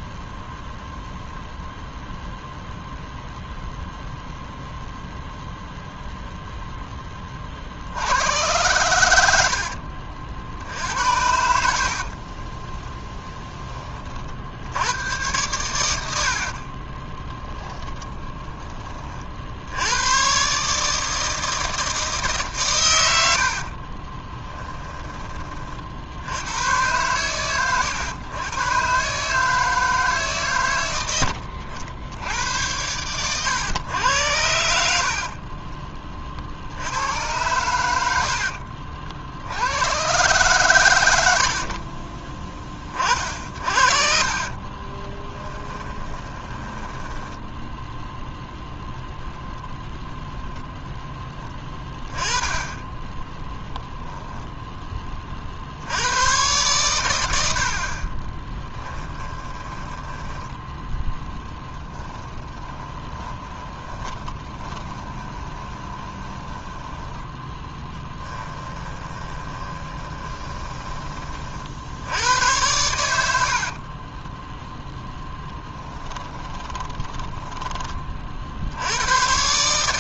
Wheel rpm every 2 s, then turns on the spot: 0, 0, 0, 10, 100, 70, 10, 90, 30, 30, 150, 110, 10, 120, 130, 100, 100, 60, 70, 60, 100, 30, 20, 10, 0, 0, 10, 20, 110, 30, 10, 20, 20, 10, 20, 20, 90, 0, 10, 80.
16-18 38-40 44-48 58-66 68-70 76-78